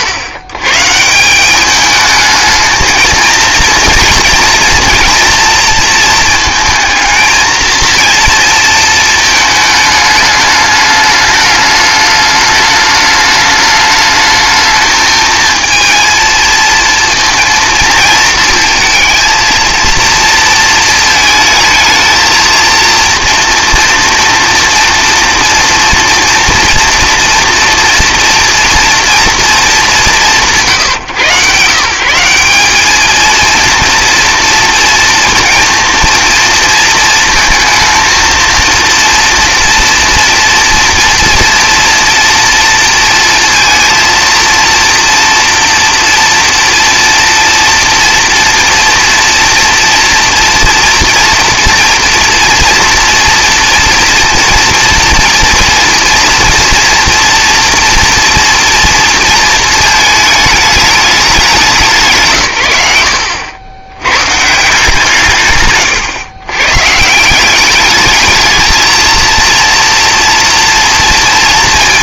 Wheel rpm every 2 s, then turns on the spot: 130, 220, 230, 230, 230, 210, 210, 220, 230, 220, 230, 230, 230, 230, 230, 140, 200, 230, 230, 230, 230, 230, 230, 230, 240, 230, 230, 240, 230, 230, 210, 110, 160, 120, 220, 230.
none